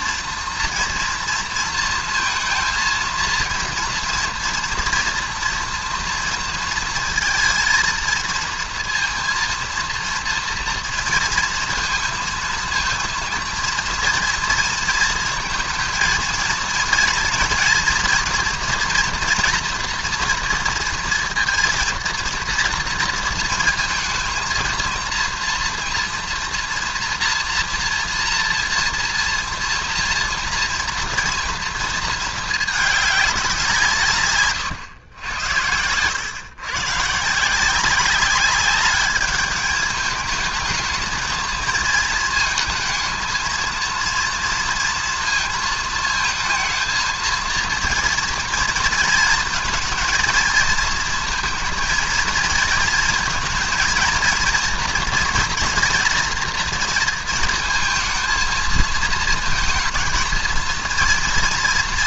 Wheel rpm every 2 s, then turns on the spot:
230, 230, 230, 230, 230, 230, 230, 230, 230, 230, 230, 230, 230, 230, 230, 240, 230, 140, 110, 190, 210, 220, 230, 230, 230, 230, 230, 230, 230, 220, 220.
none